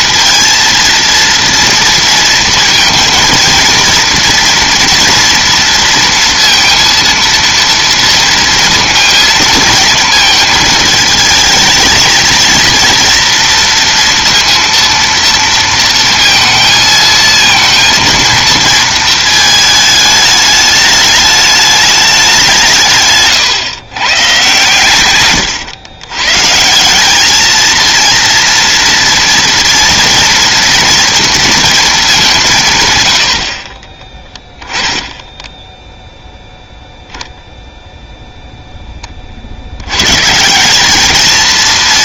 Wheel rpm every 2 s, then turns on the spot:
230, 220, 230, 230, 230, 230, 230, 230, 230, 230, 210, 170, 130, 140, 230, 230, 160, 10, 0, 0, 170.
none